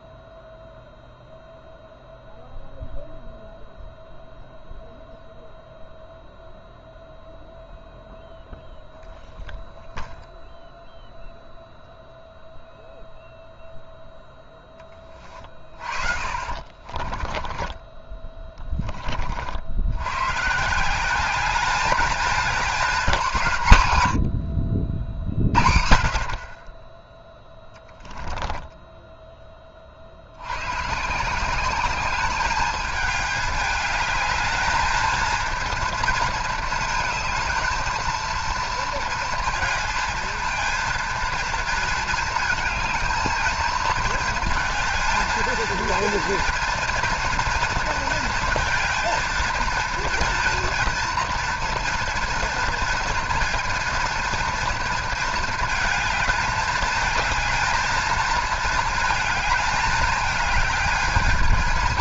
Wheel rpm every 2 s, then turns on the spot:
0, 0, 0, 0, 0, 0, 0, 10, 30, 20, 160, 220, 60, 30, 10, 100, 210, 220, 230, 230, 230, 220, 230, 230, 230, 240, 240, 230, 220, 220, 210.
16-18 28-30